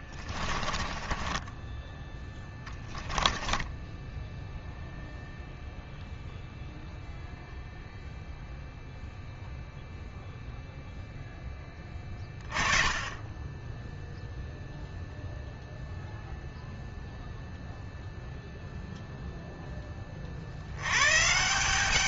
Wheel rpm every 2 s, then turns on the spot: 20, 10, 0, 0, 0, 0, 20, 0, 0, 0, 100.
0-4